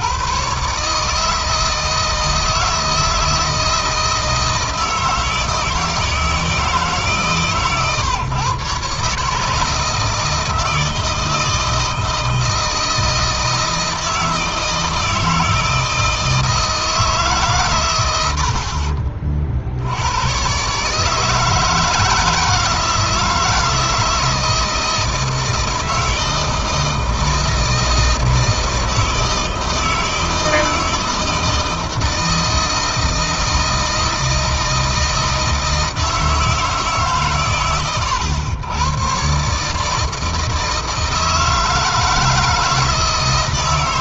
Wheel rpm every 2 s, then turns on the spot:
140, 160, 160, 150, 140, 160, 160, 160, 160, 60, 140, 160, 160, 160, 160, 160, 160, 160, 150, 120, 160, 160.
none